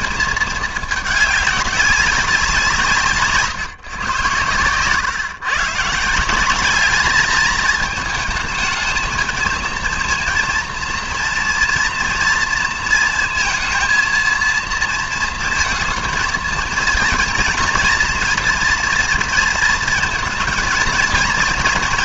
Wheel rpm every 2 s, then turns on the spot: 220, 170, 120, 210, 220, 230, 230, 230, 230, 240, 220.
4-6